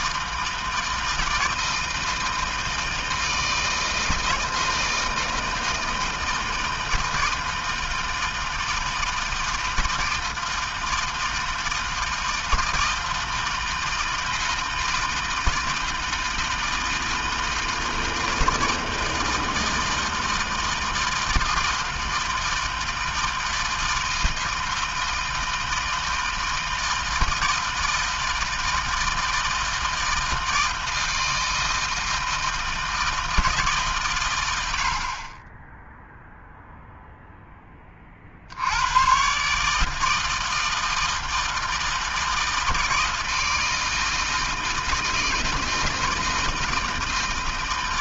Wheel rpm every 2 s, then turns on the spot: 160, 160, 160, 160, 160, 160, 160, 160, 160, 160, 160, 160, 160, 160, 160, 160, 160, 40, 0, 120, 160, 160, 160, 160.
none